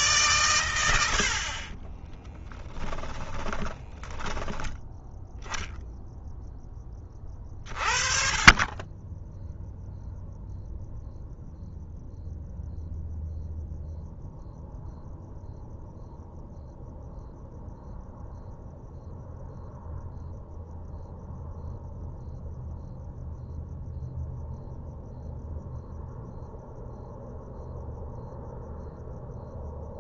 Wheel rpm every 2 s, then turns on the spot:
100, 10, 10, 20, 10, 0, 0, 0, 0, 0, 0, 0, 0, 0, 0.
2-4